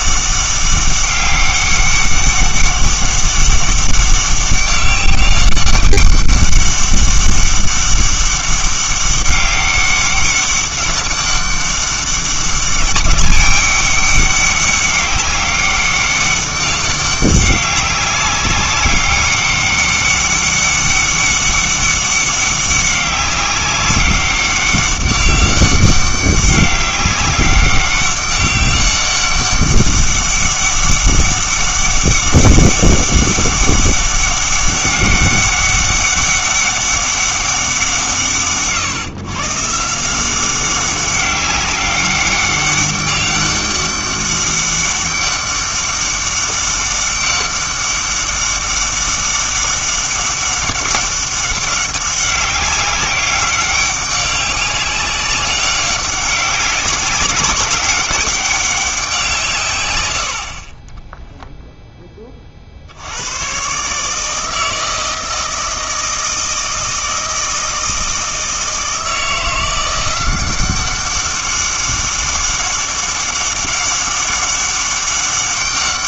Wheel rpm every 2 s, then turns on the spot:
200, 200, 200, 200, 200, 200, 200, 200, 200, 200, 200, 200, 190, 200, 200, 200, 200, 200, 200, 120, 190, 200, 200, 200, 200, 200, 190, 200, 200, 190, 40, 50, 160, 160, 160, 190, 200, 200.
none